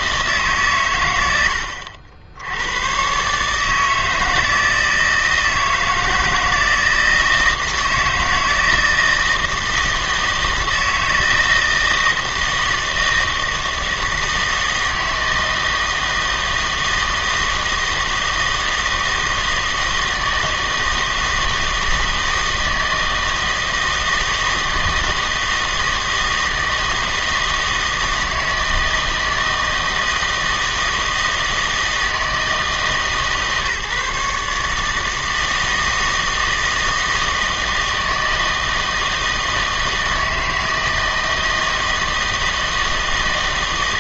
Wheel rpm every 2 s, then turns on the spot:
130, 100, 160, 160, 160, 160, 160, 160, 160, 160, 160, 160, 160, 160, 160, 160, 150, 150, 160, 160, 160, 160.
none